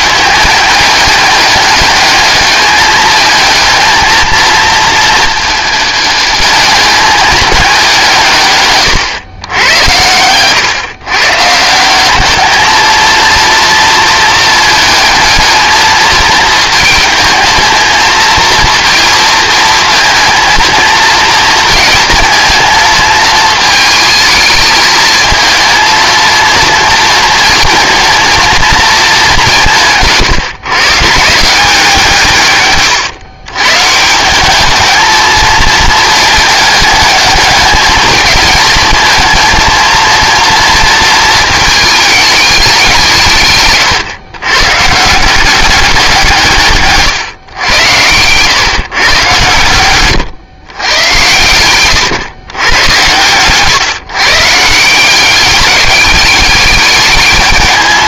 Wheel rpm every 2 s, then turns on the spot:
210, 210, 220, 210, 130, 130, 220, 220, 220, 230, 230, 220, 220, 230, 210, 130, 130, 220, 210, 230, 230, 170, 150, 140, 130, 120, 110, 170, 210.
none